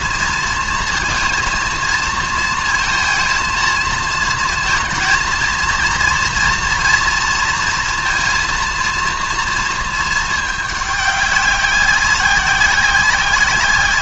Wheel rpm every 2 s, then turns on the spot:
220, 230, 230, 230, 230, 210, 190.
none